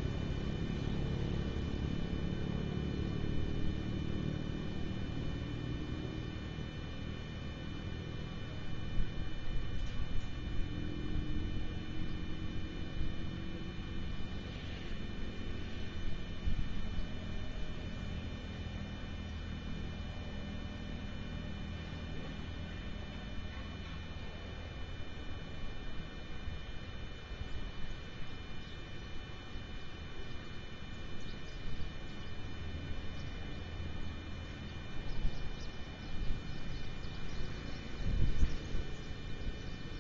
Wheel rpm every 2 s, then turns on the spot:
0, 0, 0, 0, 0, 0, 0, 0, 0, 0, 0, 0, 0, 0, 0, 0, 0, 0, 0, 0.
none